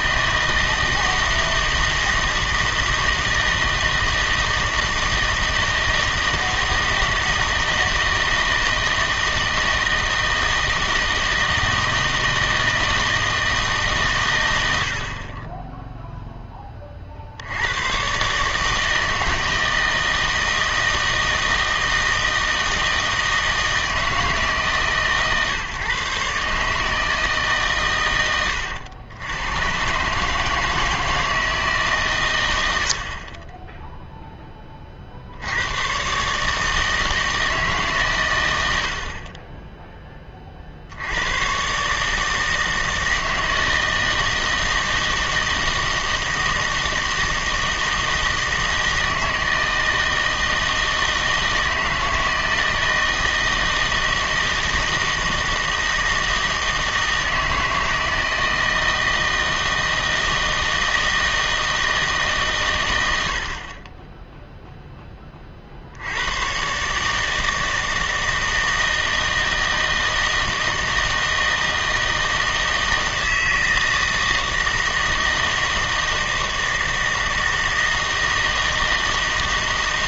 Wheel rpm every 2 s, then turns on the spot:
160, 160, 160, 160, 160, 160, 160, 90, 20, 150, 160, 160, 150, 150, 90, 160, 100, 20, 150, 80, 50, 160, 160, 160, 160, 160, 160, 160, 160, 160, 160, 120, 0, 130, 160, 160, 160, 160, 160, 160.
none